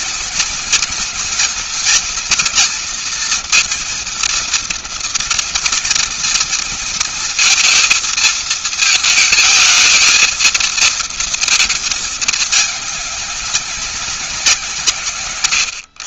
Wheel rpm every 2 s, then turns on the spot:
230, 230, 230, 230, 230, 220, 210, 190.
none